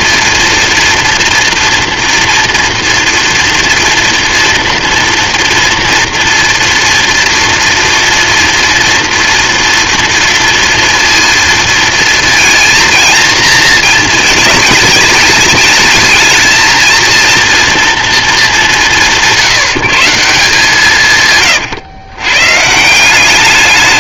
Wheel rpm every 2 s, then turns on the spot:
230, 230, 230, 230, 230, 230, 230, 220, 220, 200, 170, 140.
none